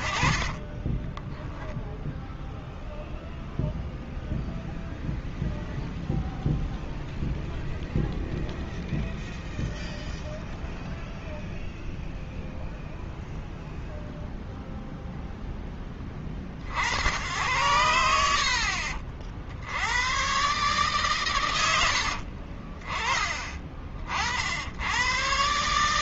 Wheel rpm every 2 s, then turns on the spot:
30, 0, 0, 0, 0, 0, 0, 0, 30, 70, 110, 50, 70.
22-24